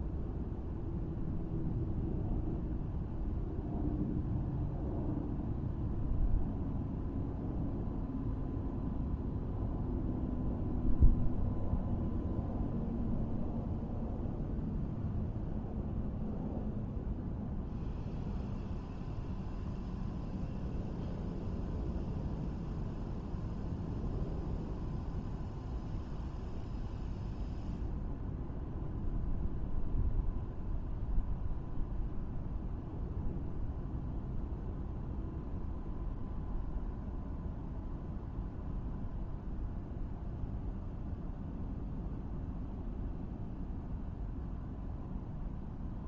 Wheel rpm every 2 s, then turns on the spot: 0, 0, 0, 0, 0, 0, 0, 0, 0, 0, 0, 0, 0, 0, 0, 0, 0, 0, 0, 0, 0, 0, 0.
none